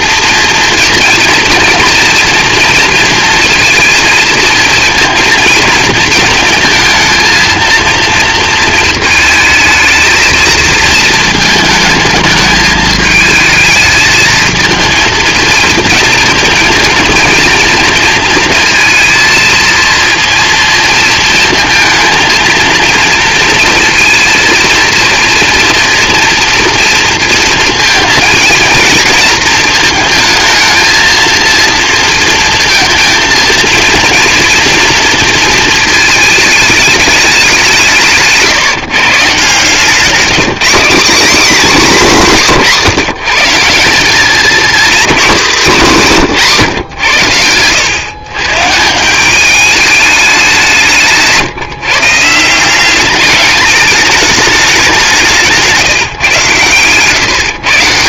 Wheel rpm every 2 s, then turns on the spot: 230, 230, 230, 220, 220, 230, 220, 230, 230, 230, 230, 230, 230, 230, 230, 220, 230, 230, 210, 160, 220, 200, 220, 150, 150, 180, 180, 200, 130.
none